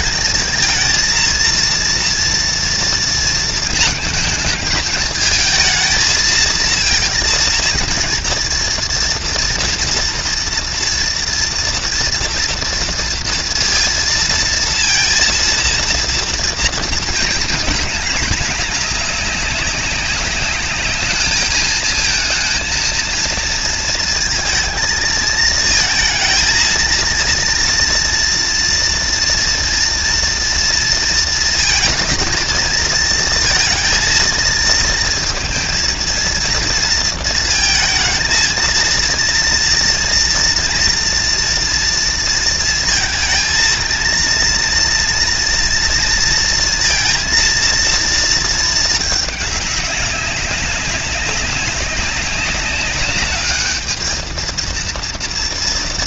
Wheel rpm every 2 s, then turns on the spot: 220, 230, 220, 230, 230, 230, 230, 230, 220, 210, 210, 230, 230, 230, 230, 230, 230, 230, 230, 230, 240, 220, 230, 230, 220, 200, 200, 230.
none